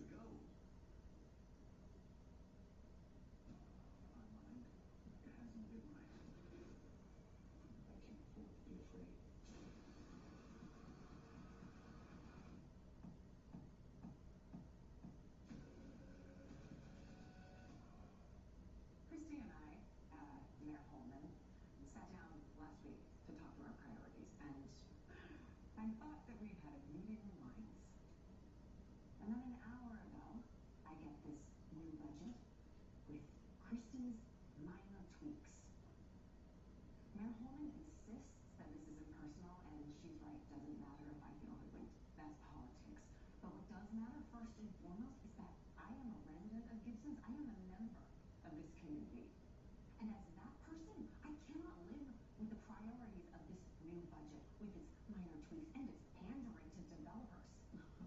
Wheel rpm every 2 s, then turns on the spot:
0, 0, 0, 0, 0, 0, 0, 0, 0, 0, 0, 0, 0, 0, 0, 0, 0, 0, 0, 0, 0, 0, 0, 0, 0, 0, 0, 0, 0.
none